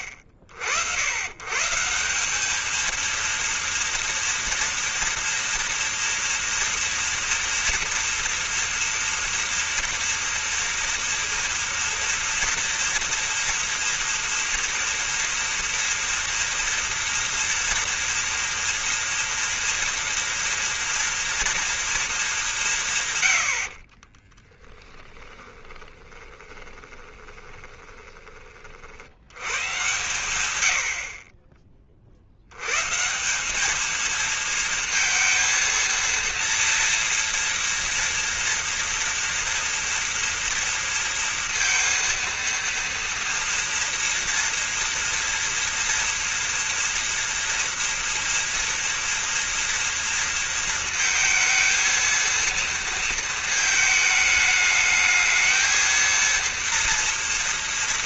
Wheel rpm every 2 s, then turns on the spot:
70, 220, 230, 230, 240, 230, 230, 230, 230, 230, 230, 170, 20, 20, 30, 110, 130, 230, 230, 230, 230, 240, 230, 240, 230, 230, 230, 210, 230.
24-28